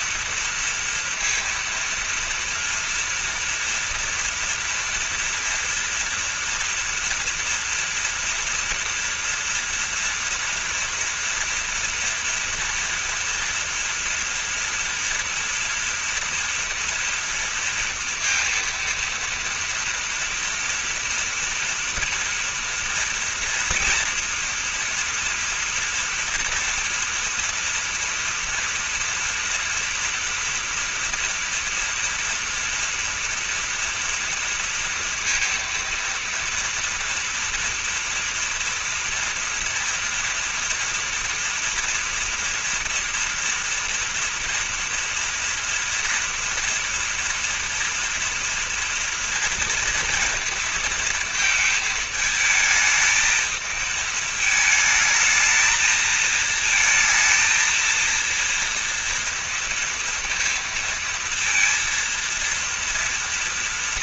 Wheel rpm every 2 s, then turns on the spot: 230, 230, 230, 230, 230, 240, 230, 240, 230, 230, 230, 240, 230, 230, 230, 230, 230, 230, 230, 230, 240, 240, 240, 230, 230, 230, 220, 220, 220, 230, 230, 230.
none